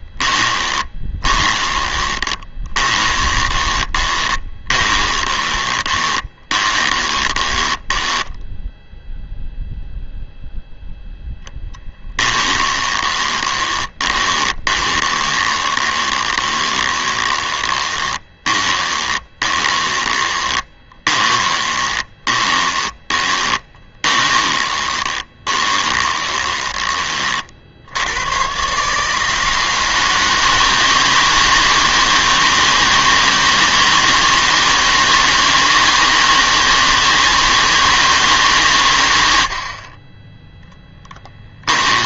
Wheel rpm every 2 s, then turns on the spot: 20, 20, 20, 20, 0, 0, 20, 20, 20, 20, 20, 20, 20, 20, 150, 160, 160, 160, 160, 120, 10.
0-8 12-26 40-42